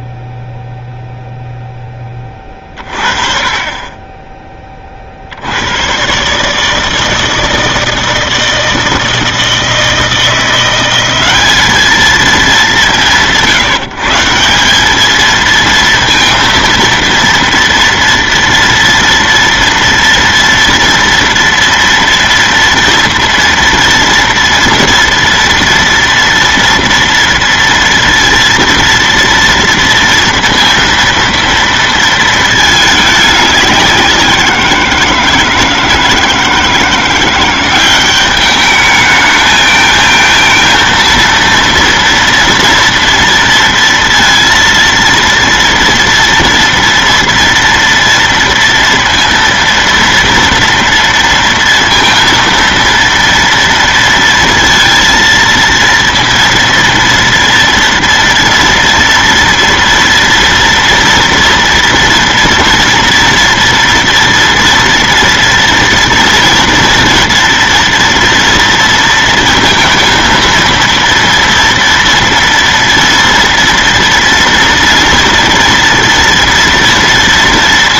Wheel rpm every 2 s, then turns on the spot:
0, 30, 20, 150, 160, 170, 160, 180, 230, 230, 230, 230, 230, 230, 230, 230, 220, 170, 160, 210, 230, 230, 230, 230, 230, 230, 230, 230, 230, 230, 230, 230, 230, 230, 230, 230, 230, 230, 230.
none